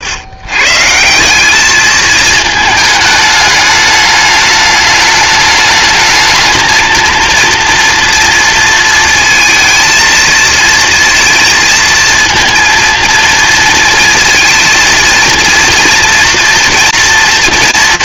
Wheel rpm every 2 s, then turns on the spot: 150, 220, 210, 220, 230, 230, 230, 230, 230.
none